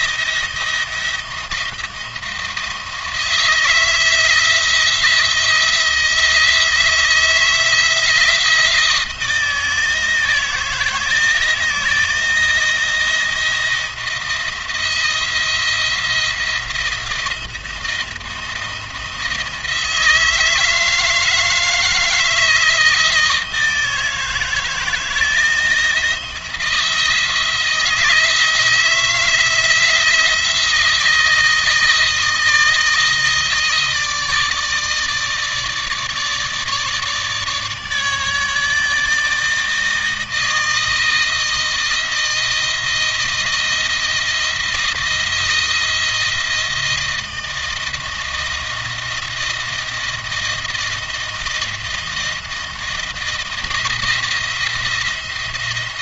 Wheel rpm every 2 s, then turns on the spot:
160, 160, 160, 160, 160, 160, 170, 160, 170, 170, 160, 160, 160, 170, 160, 170, 160, 150, 150, 150, 160, 160, 160, 160, 160, 160, 160, 170.
none